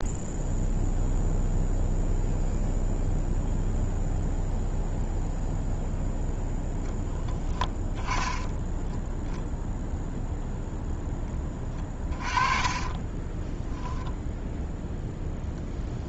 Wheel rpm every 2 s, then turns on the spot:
0, 0, 0, 0, 10, 0, 20, 0.
12-14